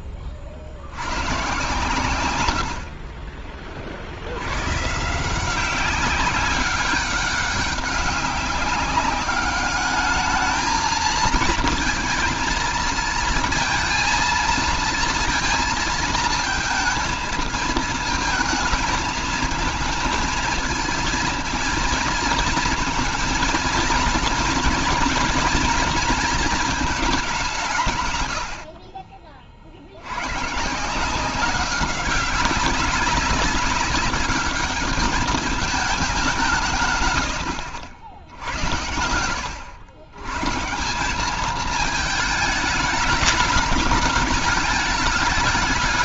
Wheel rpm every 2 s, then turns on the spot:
50, 70, 130, 200, 200, 220, 230, 230, 220, 220, 230, 220, 230, 210, 40, 160, 190, 200, 150, 70, 180, 210, 220.
none